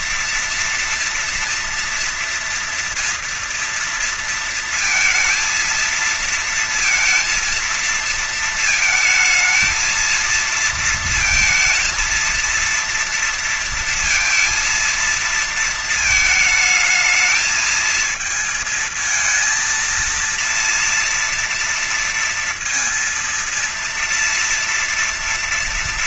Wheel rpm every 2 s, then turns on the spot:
230, 230, 230, 230, 220, 230, 230, 230, 220, 220, 230, 230, 230.
none